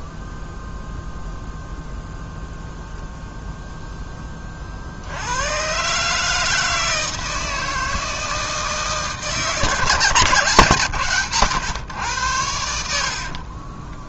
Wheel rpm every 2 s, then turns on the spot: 0, 0, 70, 160, 150, 130, 60.
12-14